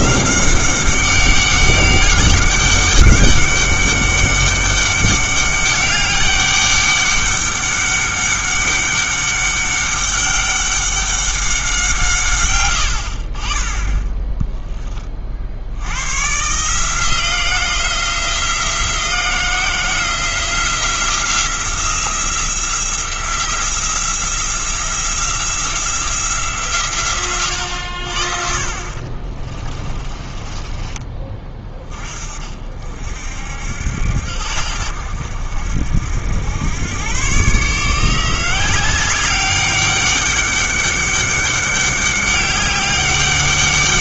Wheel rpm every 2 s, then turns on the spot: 190, 190, 200, 200, 200, 200, 110, 10, 150, 170, 170, 170, 170, 140, 60, 30, 50, 80, 100, 180, 200, 200.
28-32